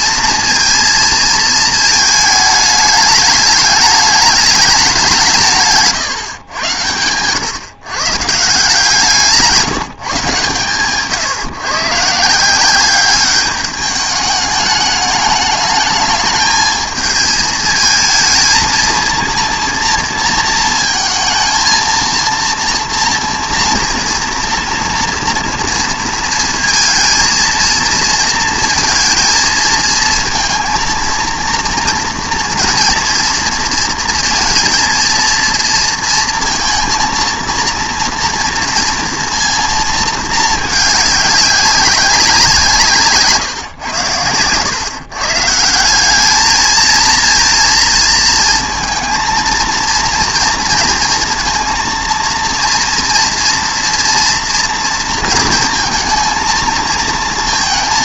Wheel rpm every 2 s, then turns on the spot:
230, 210, 190, 110, 160, 140, 190, 210, 220, 230, 230, 230, 230, 230, 220, 230, 230, 230, 230, 240, 210, 150, 120, 220, 230, 230, 230, 230, 230.
none